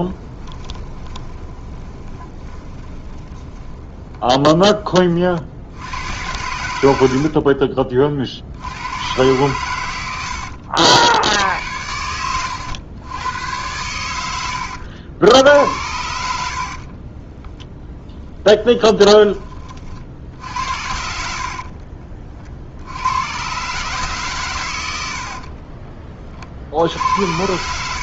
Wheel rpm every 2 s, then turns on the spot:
10, 20, 30, 80, 80, 70, 90, 90, 60, 10, 70, 60, 120, 50.
0-6 16-18